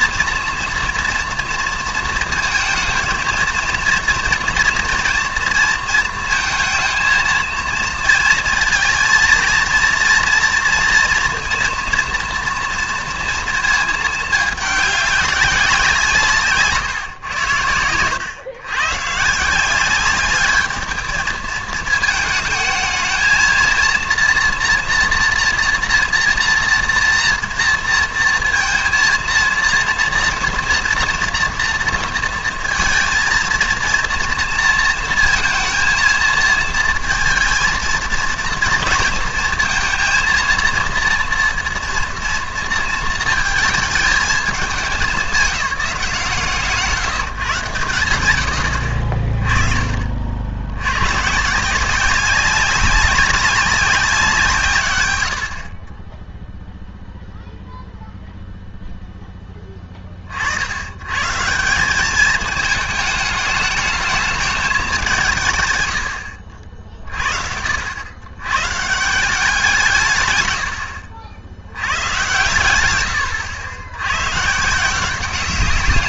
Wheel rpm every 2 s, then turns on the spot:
230, 230, 230, 230, 230, 230, 240, 210, 150, 120, 210, 220, 230, 230, 230, 230, 230, 230, 220, 230, 230, 230, 210, 140, 90, 80, 190, 160, 0, 0, 80, 220, 210, 60, 120, 110, 120, 150.
16-18